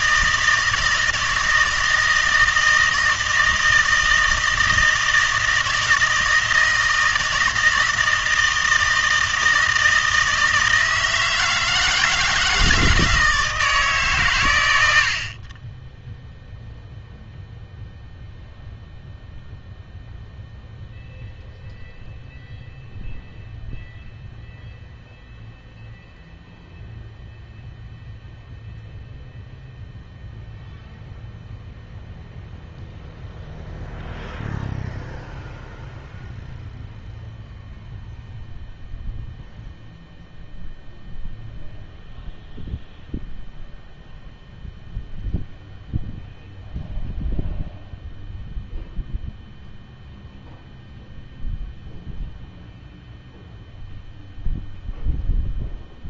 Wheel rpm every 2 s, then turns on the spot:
160, 160, 160, 160, 160, 160, 160, 110, 0, 0, 0, 0, 0, 0, 0, 0, 0, 0, 0, 0, 0, 0, 0, 0, 0, 0, 0, 0.
none